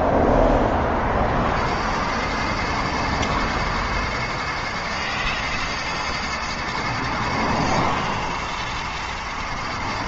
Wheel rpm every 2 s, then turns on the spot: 20, 110, 120, 120, 110.
none